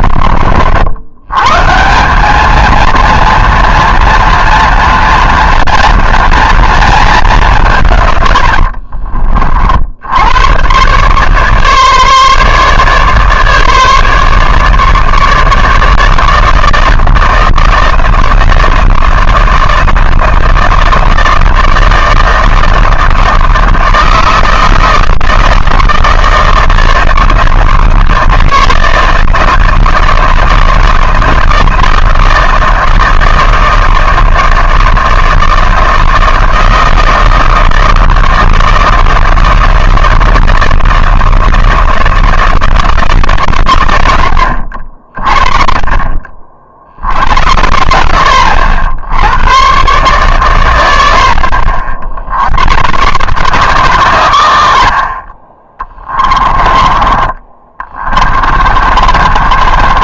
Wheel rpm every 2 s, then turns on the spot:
50, 230, 230, 230, 70, 120, 150, 150, 160, 160, 160, 160, 160, 160, 160, 160, 160, 160, 160, 160, 160, 160, 60, 50, 80, 100, 100, 70, 30, 40.
8-10 56-60